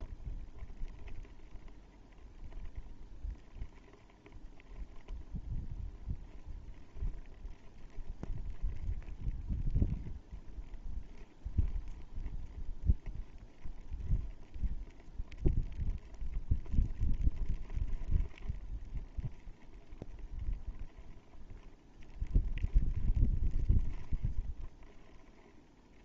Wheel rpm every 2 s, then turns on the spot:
0, 0, 0, 0, 0, 0, 0, 0, 0, 0, 0, 0, 0.
none